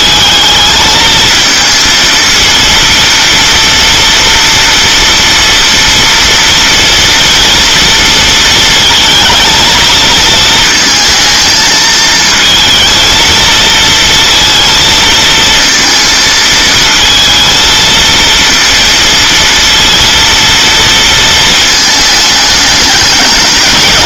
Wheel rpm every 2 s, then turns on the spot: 220, 230, 230, 230, 230, 220, 220, 230, 230, 230, 230, 220.
none